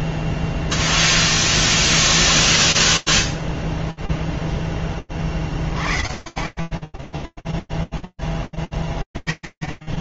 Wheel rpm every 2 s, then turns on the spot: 0, 0, 10, 30, 10.
none